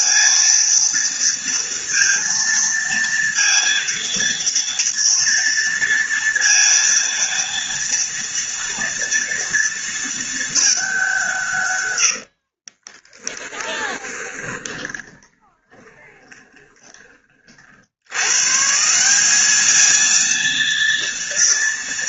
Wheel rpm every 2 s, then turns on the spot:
230, 230, 230, 230, 230, 210, 40, 20, 20, 150, 230.
12-18